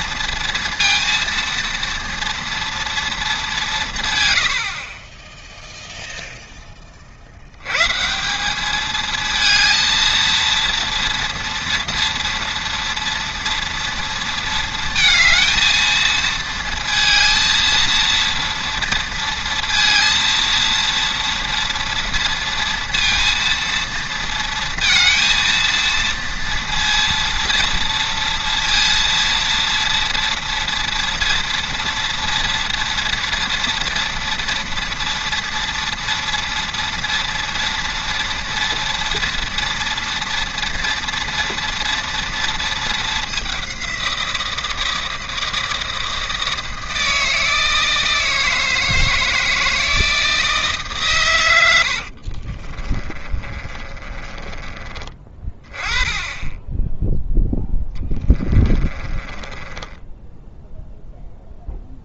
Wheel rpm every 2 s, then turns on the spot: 230, 230, 30, 40, 220, 230, 230, 230, 230, 230, 230, 230, 230, 230, 230, 230, 230, 230, 230, 230, 230, 220, 170, 160, 160, 150, 30, 20, 10, 20, 0.
52-54 58-60